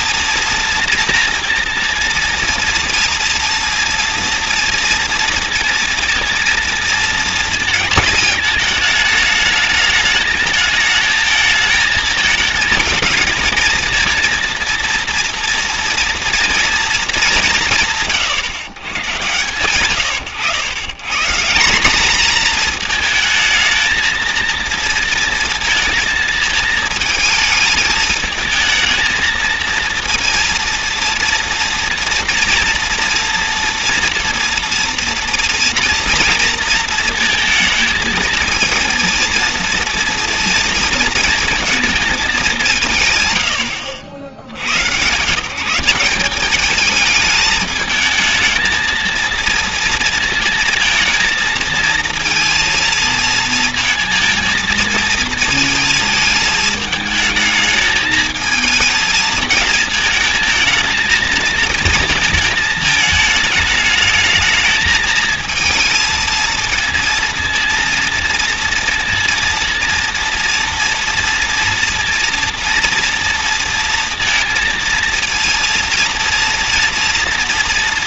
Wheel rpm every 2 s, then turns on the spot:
230, 230, 230, 230, 220, 210, 230, 230, 230, 120, 100, 220, 230, 220, 220, 230, 230, 230, 220, 230, 230, 190, 80, 210, 220, 230, 230, 230, 220, 220, 220, 230, 220, 230, 230, 230, 230, 230, 230.
none